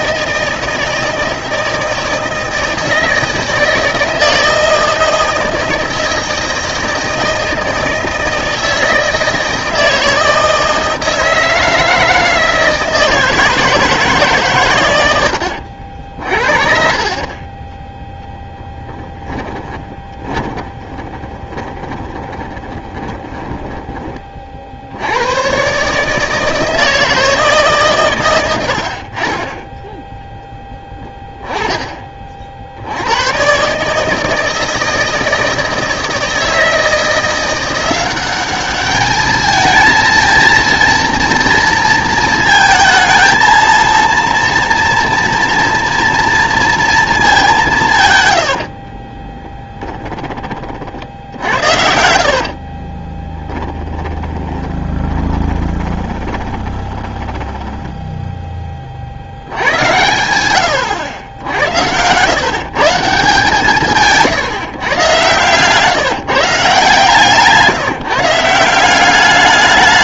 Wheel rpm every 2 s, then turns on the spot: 160, 160, 160, 160, 160, 160, 160, 120, 40, 10, 20, 20, 50, 160, 80, 10, 60, 160, 160, 210, 230, 230, 230, 230, 70, 40, 40, 20, 20, 10, 100, 150, 130, 150, 180.
20-24 48-50 52-58